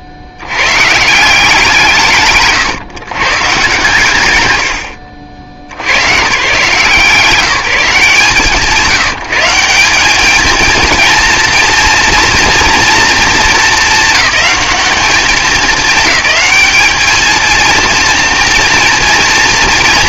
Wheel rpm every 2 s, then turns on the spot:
80, 120, 70, 130, 170, 220, 240, 220, 210, 230.
none